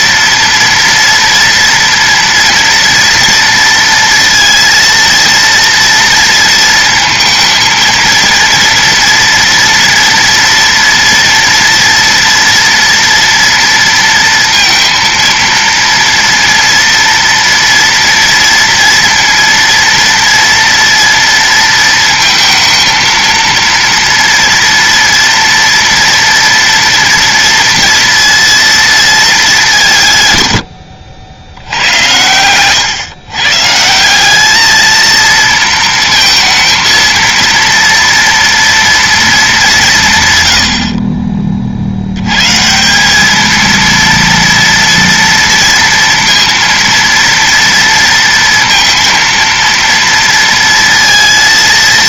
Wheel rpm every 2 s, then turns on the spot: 230, 230, 230, 230, 230, 230, 230, 230, 240, 230, 230, 230, 230, 230, 230, 100, 120, 210, 230, 230, 90, 140, 230, 230, 230, 230.
none